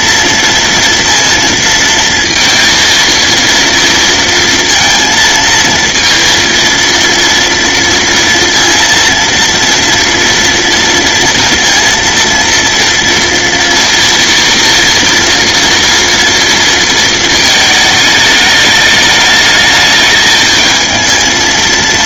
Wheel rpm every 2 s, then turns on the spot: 230, 230, 230, 230, 230, 230, 230, 230, 230, 210, 220.
none